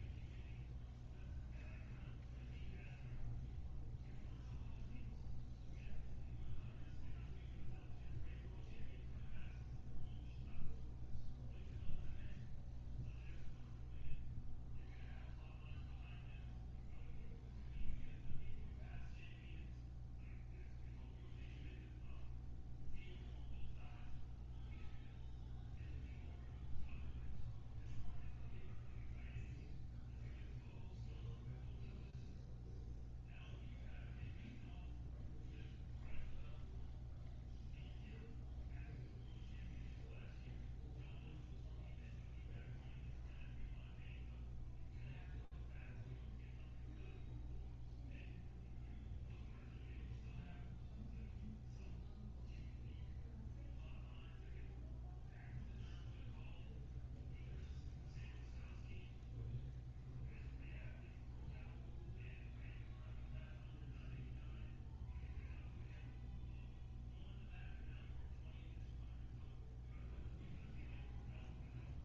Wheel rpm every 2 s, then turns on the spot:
0, 0, 0, 0, 0, 0, 0, 0, 0, 0, 0, 0, 0, 0, 0, 0, 0, 0, 0, 0, 0, 0, 0, 0, 0, 0, 0, 0, 0, 0, 0, 0, 0, 0, 0, 0.
none